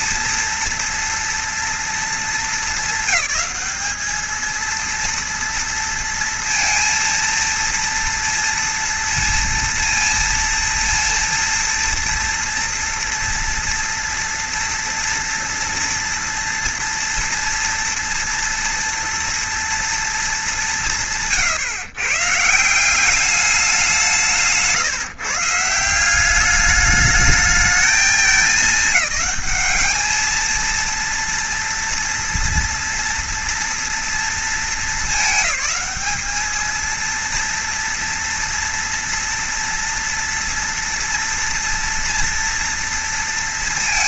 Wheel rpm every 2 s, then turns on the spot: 230, 210, 230, 230, 230, 230, 230, 230, 240, 240, 160, 190, 150, 210, 210, 230, 230, 220, 230, 240, 230, 230.
none